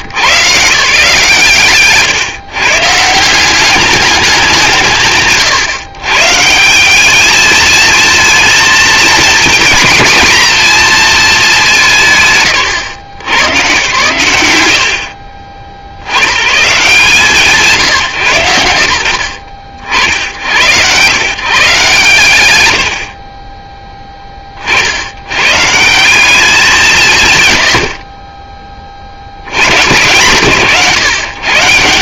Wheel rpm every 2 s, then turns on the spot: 150, 140, 140, 180, 230, 230, 130, 100, 130, 90, 100, 90, 90, 180, 50, 130.
none